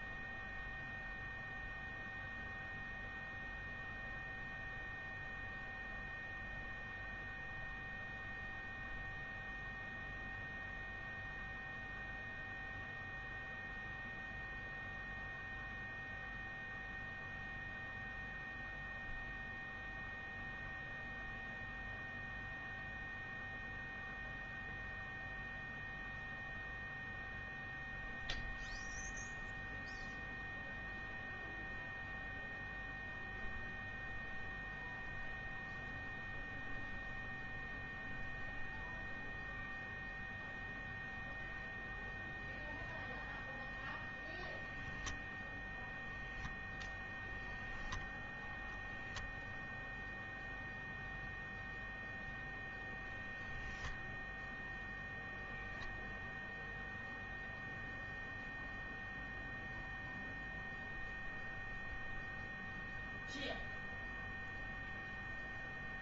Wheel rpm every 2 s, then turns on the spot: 0, 0, 0, 0, 0, 0, 0, 0, 0, 0, 0, 0, 0, 0, 0, 0, 0, 0, 0, 0, 0, 0, 0, 0, 0, 0, 0, 0, 0, 0, 0, 0, 0.
none